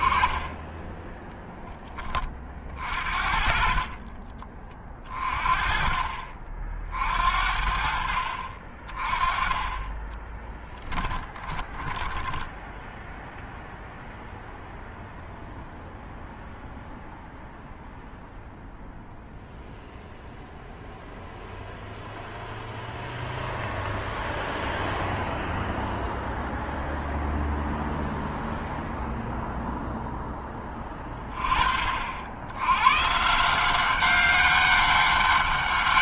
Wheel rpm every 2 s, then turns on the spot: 20, 30, 30, 50, 60, 20, 20, 0, 0, 0, 0, 0, 0, 0, 0, 10, 80, 200.
10-14